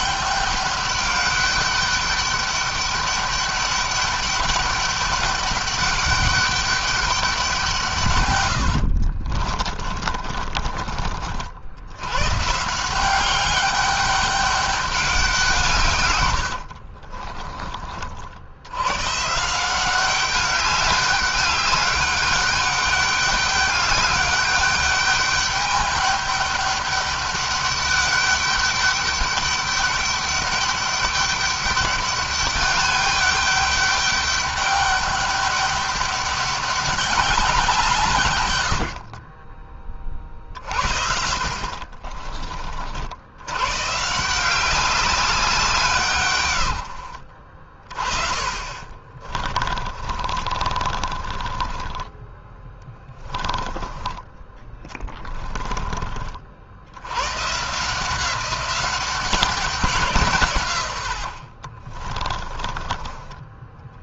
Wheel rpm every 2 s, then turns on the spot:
200, 210, 200, 200, 80, 40, 170, 200, 60, 110, 200, 200, 210, 200, 200, 200, 200, 200, 200, 80, 50, 60, 190, 90, 30, 30, 10, 10, 70, 190, 110, 20.
8-10 16-18 40-42 48-56 62-64